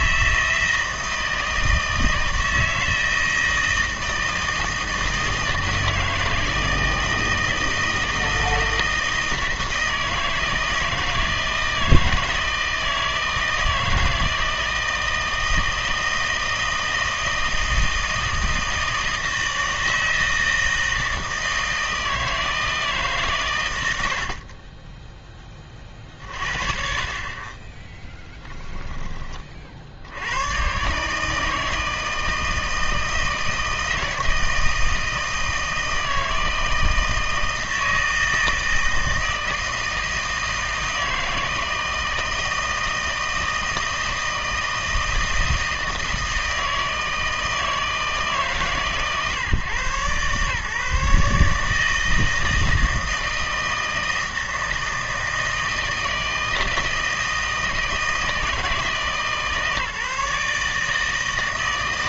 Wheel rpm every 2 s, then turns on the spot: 160, 160, 160, 160, 160, 160, 160, 160, 160, 160, 160, 160, 30, 50, 10, 130, 160, 160, 160, 160, 160, 160, 160, 160, 140, 140, 160, 160, 160, 160, 150.
24-26